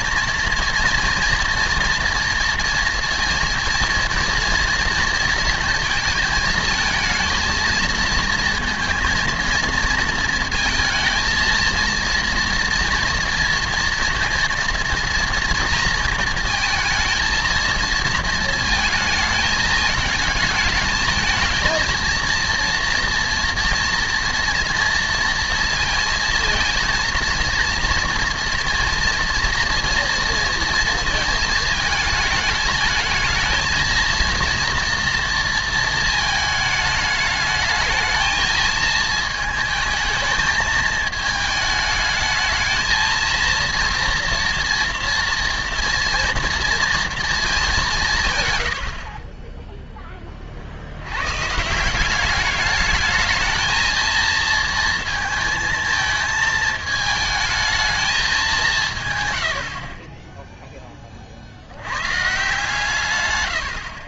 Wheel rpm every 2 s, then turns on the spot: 230, 230, 230, 220, 230, 220, 230, 230, 220, 220, 220, 230, 230, 230, 230, 230, 220, 240, 220, 220, 220, 220, 230, 230, 70, 70, 210, 230, 220, 160, 10, 150.
48-50